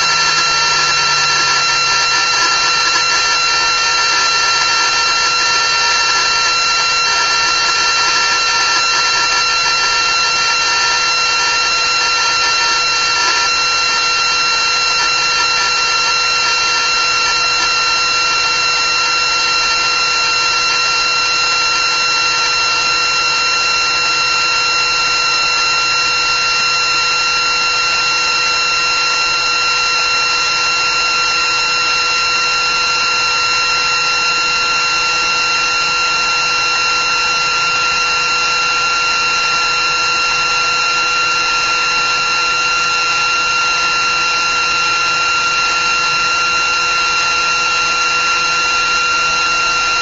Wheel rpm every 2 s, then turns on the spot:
360, 360, 360, 360, 360, 360, 360, 360, 360, 360, 360, 360, 360, 360, 350, 360, 360, 360, 360, 360, 360, 360, 360, 360, 360.
none